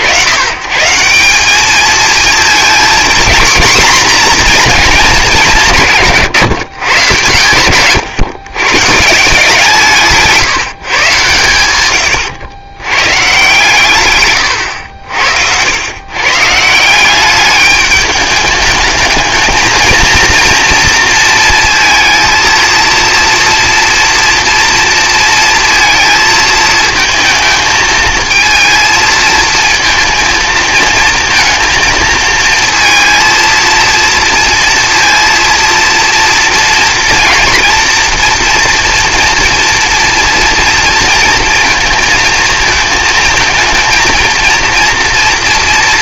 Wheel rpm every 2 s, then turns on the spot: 120, 240, 230, 140, 140, 140, 120, 90, 160, 210, 230, 230, 230, 220, 230, 220, 230, 230, 230, 230, 230, 230, 230.
none